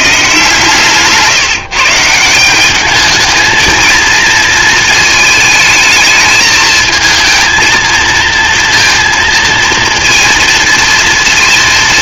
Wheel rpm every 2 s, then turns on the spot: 150, 200, 220, 220, 230, 230.
0-2